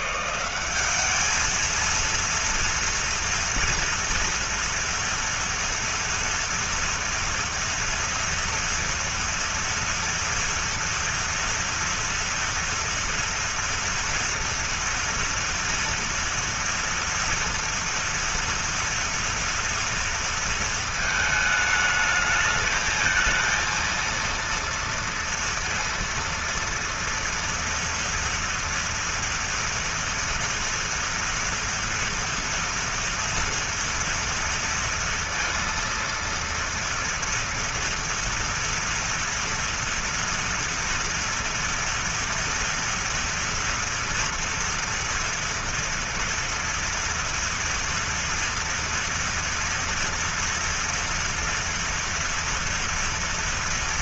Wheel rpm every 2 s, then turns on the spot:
200, 230, 230, 240, 230, 230, 230, 230, 230, 230, 220, 220, 230, 240, 240, 230, 230, 230, 230, 230, 230, 230, 230, 230, 230, 230, 230.
none